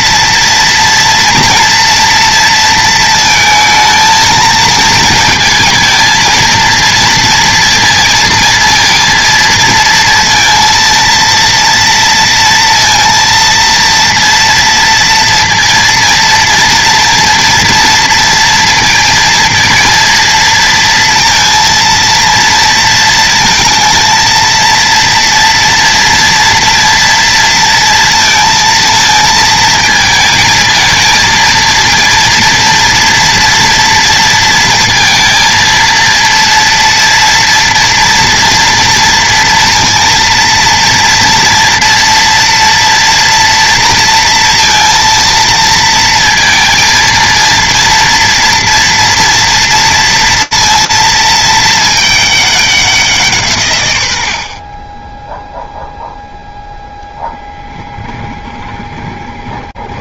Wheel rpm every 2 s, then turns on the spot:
230, 230, 220, 230, 230, 230, 230, 230, 230, 230, 230, 230, 230, 230, 230, 220, 230, 230, 230, 240, 230, 230, 230, 230, 230, 230, 200, 40, 0, 20.
58-60